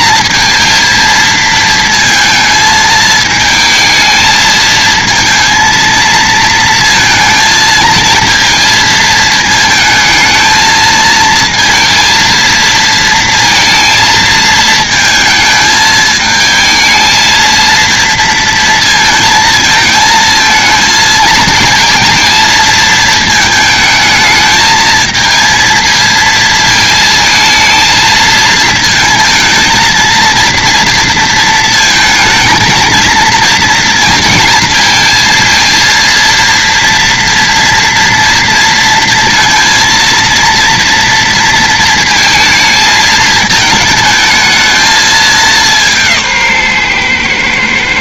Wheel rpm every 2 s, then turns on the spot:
230, 220, 220, 220, 220, 220, 230, 220, 220, 230, 220, 220, 220, 230, 230, 230, 230, 230, 230, 230, 230, 220, 220, 130.
none